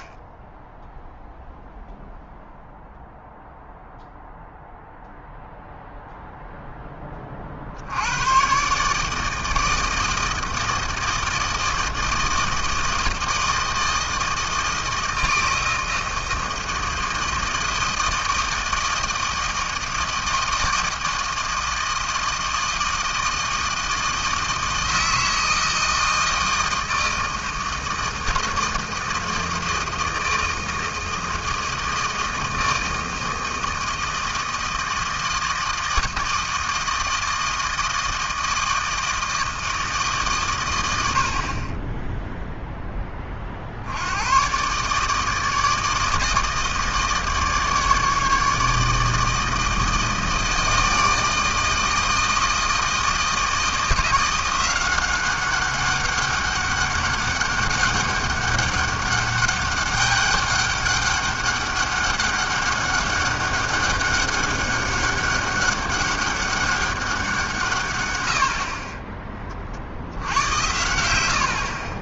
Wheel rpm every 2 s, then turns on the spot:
10, 0, 0, 0, 120, 160, 160, 160, 160, 160, 160, 160, 160, 160, 160, 160, 160, 160, 160, 160, 120, 0, 130, 160, 150, 160, 160, 180, 200, 200, 200, 200, 200, 200, 60, 80.
none